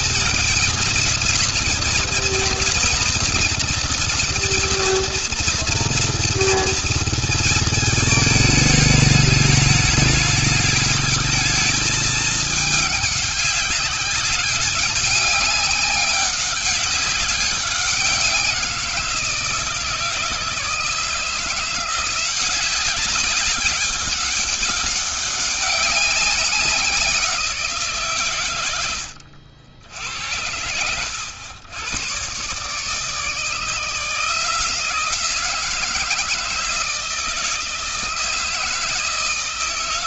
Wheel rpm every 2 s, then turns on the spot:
230, 230, 230, 230, 210, 210, 210, 200, 200, 180, 160, 190, 200, 190, 110, 90, 140, 170, 160, 160.
none